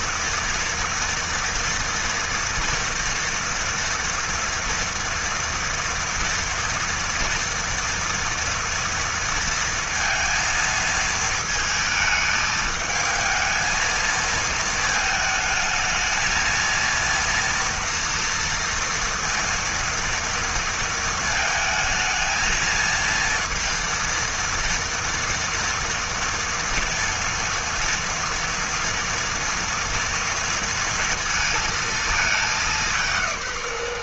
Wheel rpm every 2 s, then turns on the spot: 230, 230, 230, 230, 230, 220, 220, 220, 230, 230, 220, 230, 230, 230, 240, 230, 180.
none